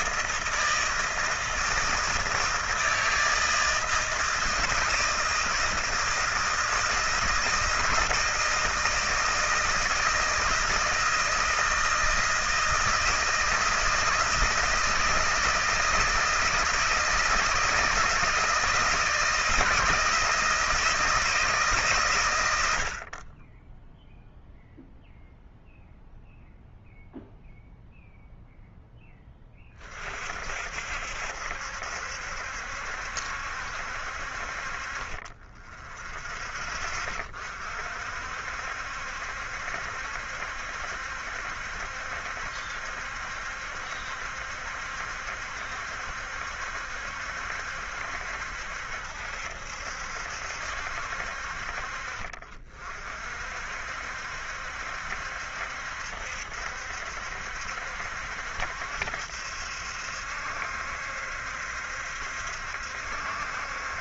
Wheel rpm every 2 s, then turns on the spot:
160, 160, 160, 160, 160, 160, 160, 160, 160, 160, 160, 80, 0, 0, 0, 60, 70, 40, 20, 60, 70, 70, 70, 70, 70, 60, 40, 70, 70, 70, 70, 70.
none